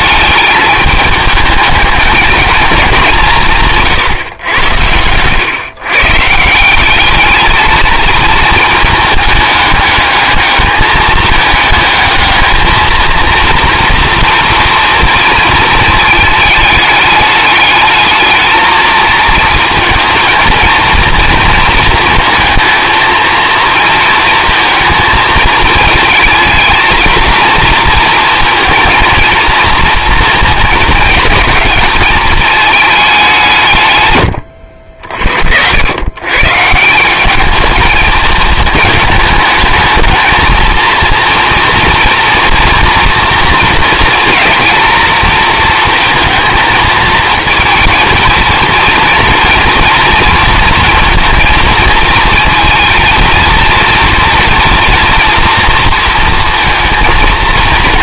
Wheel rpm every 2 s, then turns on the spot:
210, 200, 110, 200, 220, 210, 220, 230, 210, 220, 230, 230, 220, 220, 230, 230, 210, 40, 170, 210, 230, 230, 230, 220, 230, 230, 230, 230, 220.
none